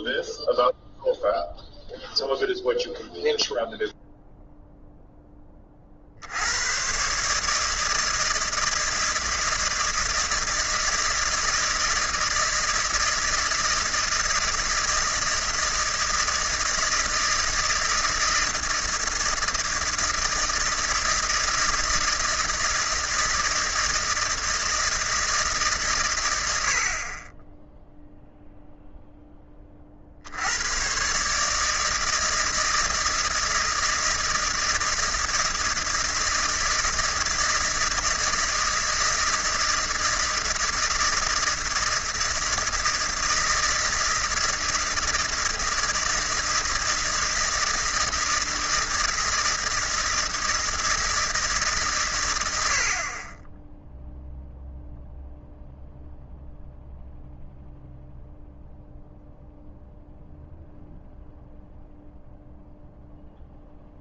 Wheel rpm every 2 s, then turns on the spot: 0, 0, 0, 110, 160, 160, 160, 160, 160, 160, 170, 160, 160, 90, 0, 90, 160, 160, 160, 160, 160, 160, 160, 160, 160, 160, 80, 0, 0, 0, 0, 0.
none